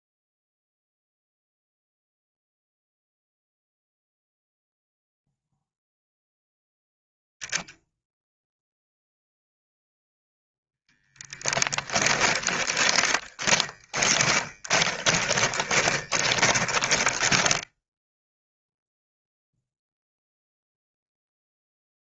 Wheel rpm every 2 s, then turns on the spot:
0, 0, 0, 0, 0, 10, 20, 20, 20, 0, 0.
10-18